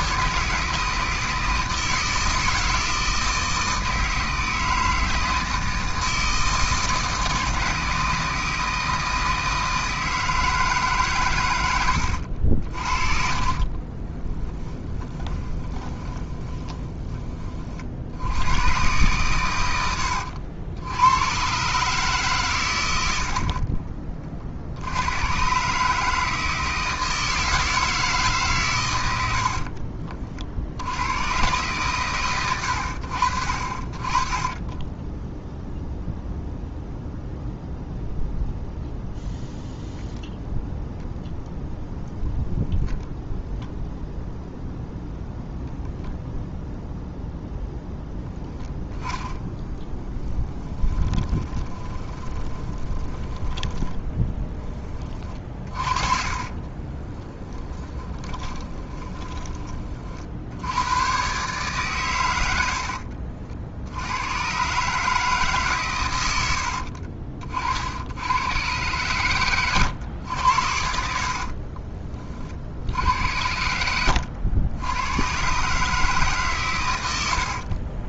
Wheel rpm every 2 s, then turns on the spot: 160, 160, 160, 160, 160, 150, 50, 10, 20, 110, 80, 110, 70, 160, 120, 70, 90, 10, 0, 0, 0, 0, 0, 0, 0, 10, 30, 20, 40, 20, 100, 80, 140, 70, 110, 80, 60, 100, 130.
12-18 50-54 56-60 62-64 66-68 70-72